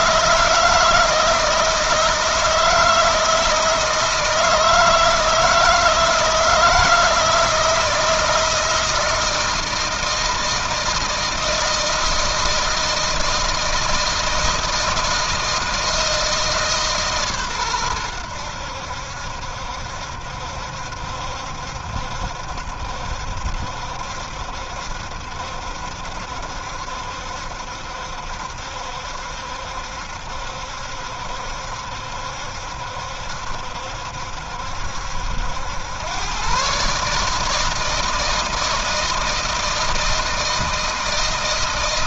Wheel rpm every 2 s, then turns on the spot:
160, 160, 160, 160, 160, 160, 160, 160, 150, 80, 70, 70, 70, 70, 70, 70, 70, 70, 140, 160, 160.
none